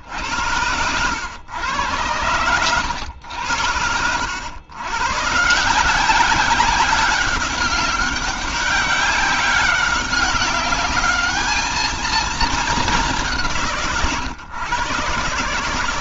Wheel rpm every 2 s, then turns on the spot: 90, 100, 100, 190, 200, 200, 210, 130.
none